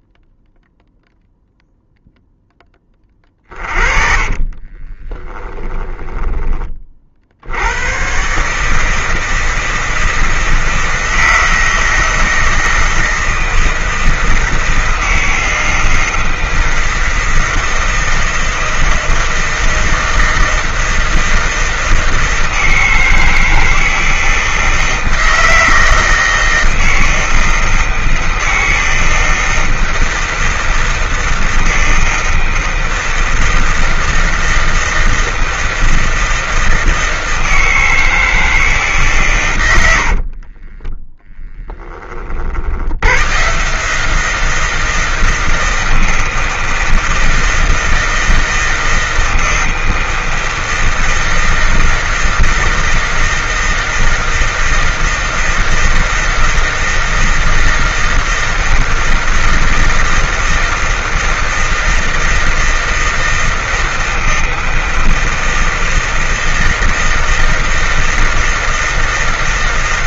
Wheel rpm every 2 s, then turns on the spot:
0, 10, 30, 30, 150, 160, 160, 160, 160, 160, 160, 160, 160, 160, 160, 160, 160, 160, 160, 160, 40, 60, 170, 160, 160, 160, 160, 160, 160, 160, 160, 160, 160, 160, 160.
4-6 40-42